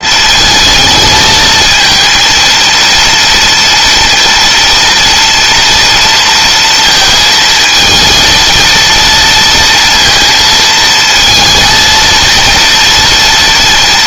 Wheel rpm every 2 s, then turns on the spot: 220, 230, 230, 230, 230, 230, 230.
none